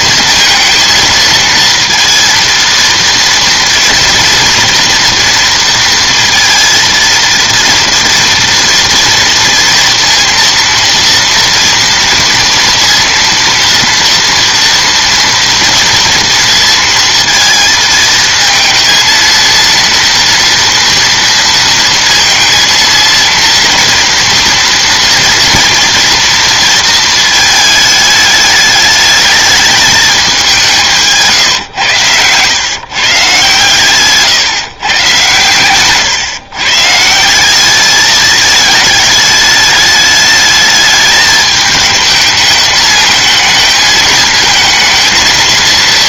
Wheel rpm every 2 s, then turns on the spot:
230, 230, 240, 230, 230, 230, 230, 230, 230, 220, 230, 230, 240, 230, 210, 190, 130, 140, 130, 220, 210, 220, 220.
none